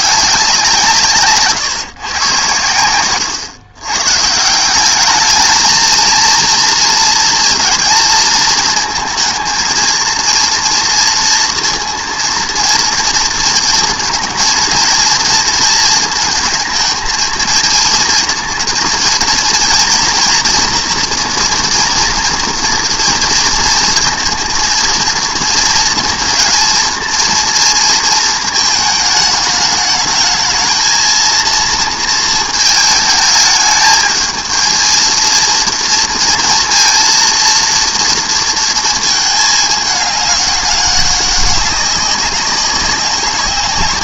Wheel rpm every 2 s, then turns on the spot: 180, 110, 180, 220, 220, 230, 230, 230, 220, 230, 230, 230, 230, 230, 220, 220, 220, 230, 230, 220, 200, 190.
none